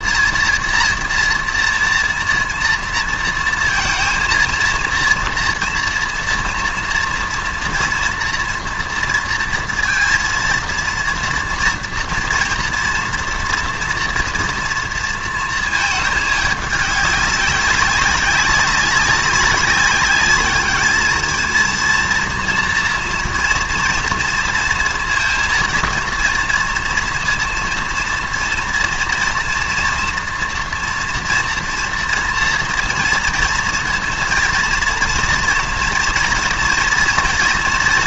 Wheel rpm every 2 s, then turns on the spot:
230, 230, 230, 230, 230, 230, 240, 230, 200, 200, 210, 230, 230, 230, 230, 230, 230, 230, 230.
none